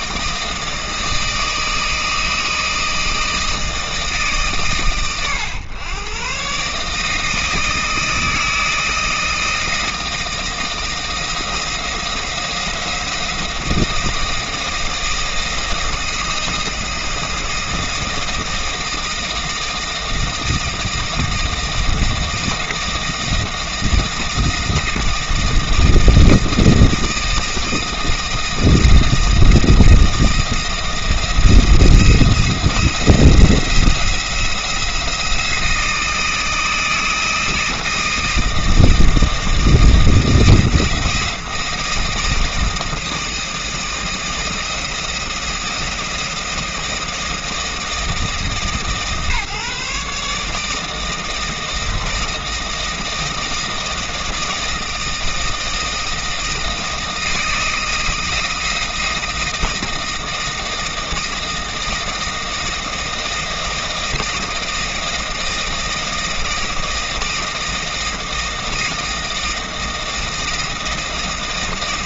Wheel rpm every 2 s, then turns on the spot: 160, 160, 140, 140, 160, 160, 170, 160, 160, 160, 160, 160, 160, 160, 160, 160, 170, 170, 160, 160, 160, 160, 160, 160, 160, 150, 160, 160, 160, 160, 170, 160, 160, 160, 160, 160.
none